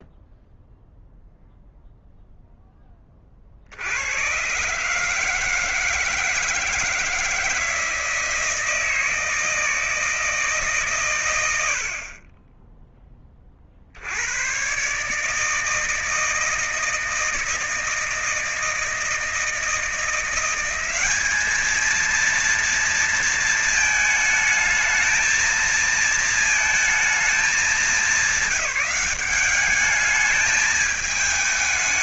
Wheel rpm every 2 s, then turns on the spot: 0, 0, 110, 160, 160, 160, 40, 90, 160, 160, 180, 230, 220, 220, 210, 210.
none